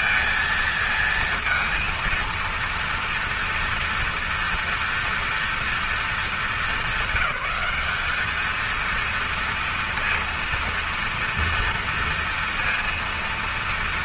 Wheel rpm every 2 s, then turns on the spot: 220, 230, 230, 200, 220, 230, 230.
none